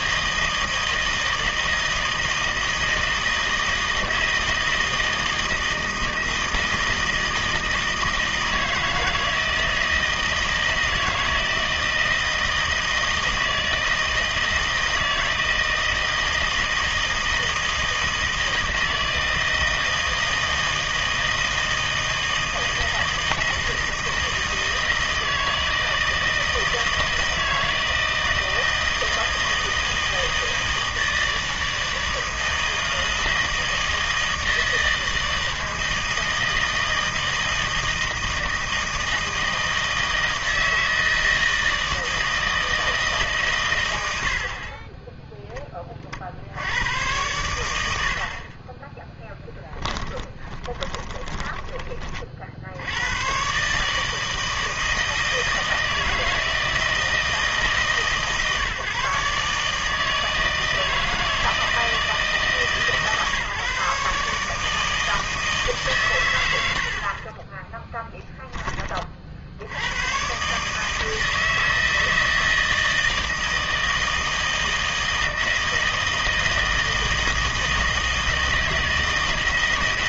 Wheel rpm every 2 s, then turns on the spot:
160, 160, 160, 160, 160, 160, 160, 160, 160, 160, 160, 160, 160, 160, 160, 160, 160, 160, 160, 160, 160, 160, 30, 90, 30, 20, 70, 160, 160, 140, 160, 150, 160, 90, 20, 140, 160, 160, 160, 160.
48-52